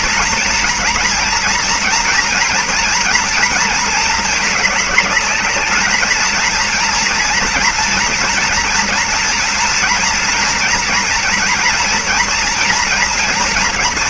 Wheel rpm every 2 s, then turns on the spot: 230, 240, 220, 230, 230, 230, 230.
none